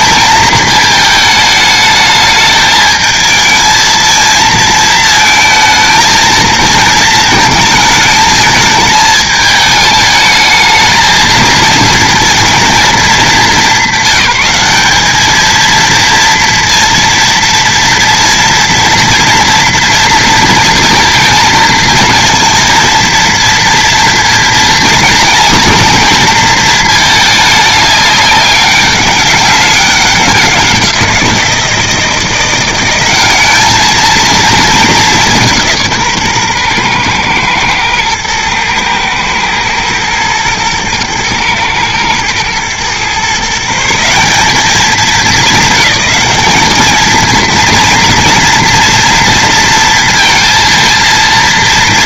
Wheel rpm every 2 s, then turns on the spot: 220, 220, 230, 230, 220, 220, 200, 200, 230, 230, 220, 230, 220, 220, 200, 180, 200, 200, 120, 120, 120, 130, 200, 220, 230, 230.
none